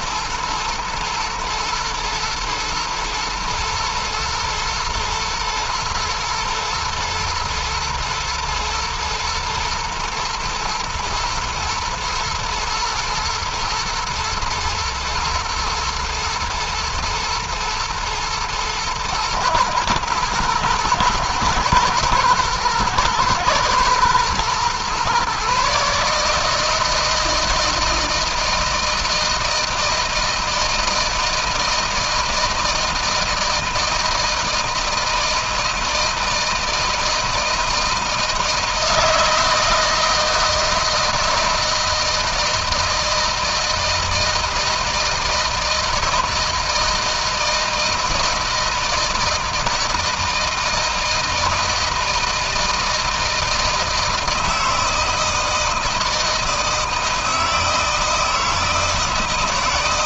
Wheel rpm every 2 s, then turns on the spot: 110, 110, 120, 120, 120, 110, 110, 110, 110, 110, 110, 110, 130, 160, 160, 160, 160, 160, 160, 160, 160, 160, 160, 160, 160, 160, 160, 160, 160, 160.
none